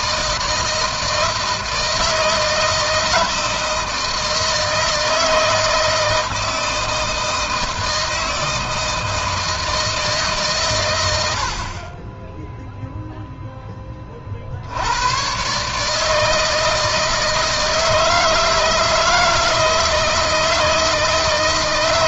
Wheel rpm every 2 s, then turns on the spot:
160, 160, 160, 160, 160, 100, 0, 80, 160, 160, 160.
none